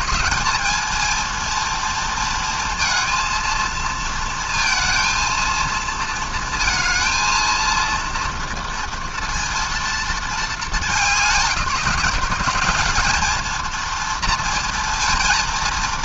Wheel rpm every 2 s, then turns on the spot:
210, 230, 230, 230, 230, 210, 200, 230.
none